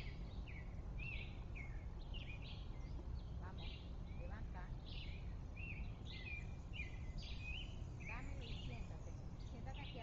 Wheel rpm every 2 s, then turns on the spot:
0, 0, 0, 0, 0.
none